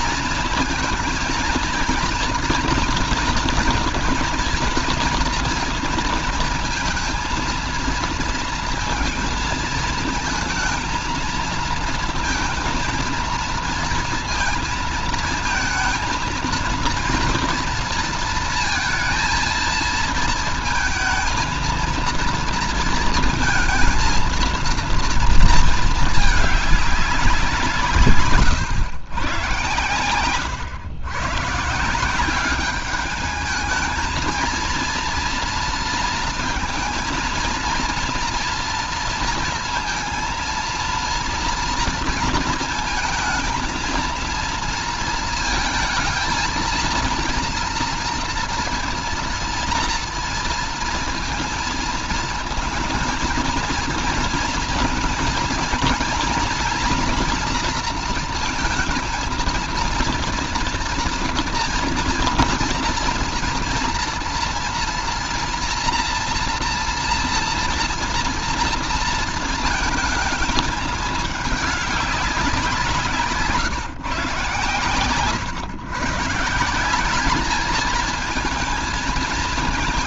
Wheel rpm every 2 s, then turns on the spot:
230, 240, 240, 230, 230, 220, 230, 230, 230, 230, 220, 230, 230, 210, 120, 120, 200, 230, 230, 230, 230, 230, 230, 230, 230, 230, 230, 230, 240, 220, 230, 230, 230, 230, 230, 220, 190, 130, 160, 220.
none